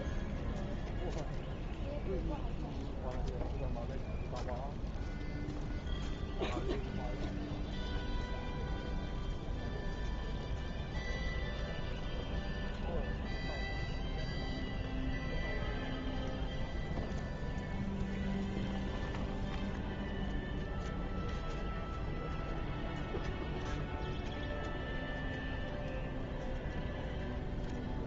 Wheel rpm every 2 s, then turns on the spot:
0, 0, 0, 0, 0, 0, 0, 0, 0, 0, 0, 0, 0, 0.
none